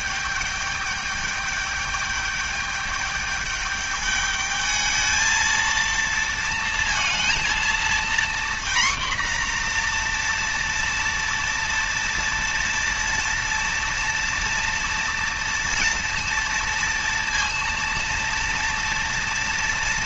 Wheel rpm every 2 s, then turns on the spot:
210, 210, 210, 230, 240, 240, 230, 230, 230, 230.
none